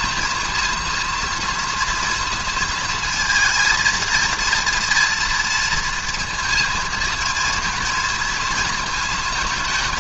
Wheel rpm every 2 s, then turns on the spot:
230, 230, 230, 230, 220.
none